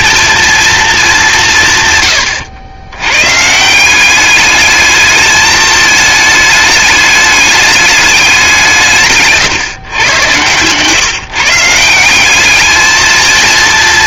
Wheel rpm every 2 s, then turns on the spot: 230, 90, 210, 210, 180, 130, 210.
10-12